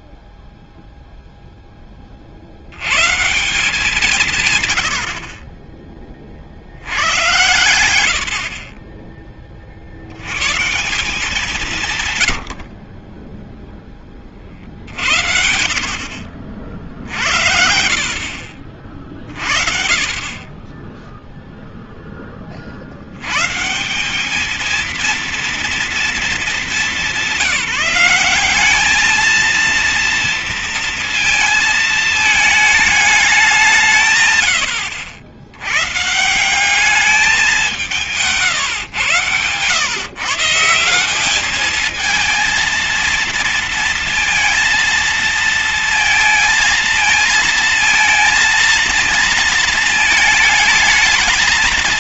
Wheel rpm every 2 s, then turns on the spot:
0, 130, 70, 110, 40, 180, 10, 70, 70, 40, 0, 150, 240, 210, 230, 220, 170, 110, 190, 120, 210, 220, 220, 220, 230, 230.
none